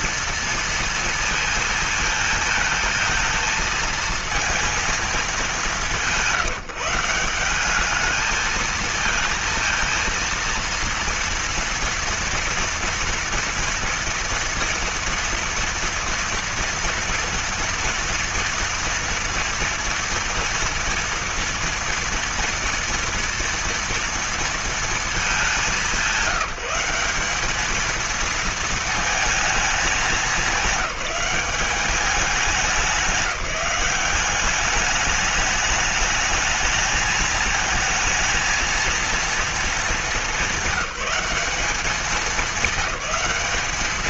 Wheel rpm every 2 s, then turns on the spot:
230, 220, 230, 170, 220, 230, 240, 230, 230, 230, 230, 230, 230, 190, 230, 210, 190, 200, 210, 230, 200, 190.
none